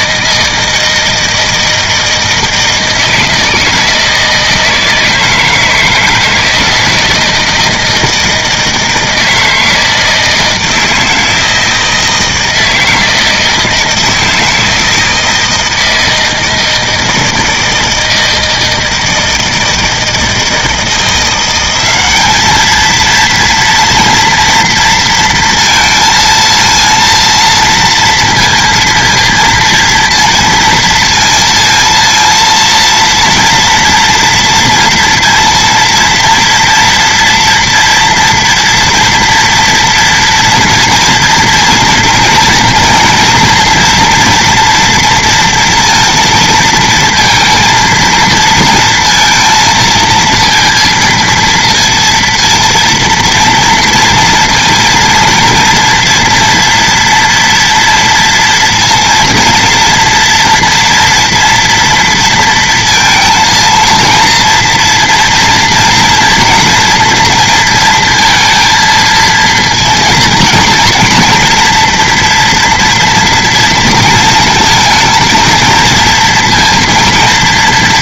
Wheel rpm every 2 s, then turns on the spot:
160, 160, 160, 160, 160, 160, 160, 160, 160, 160, 170, 230, 230, 230, 230, 230, 230, 230, 230, 230, 230, 230, 230, 230, 230, 230, 230, 230, 230, 230, 230, 230, 230, 230, 230, 230, 240, 230, 230.
none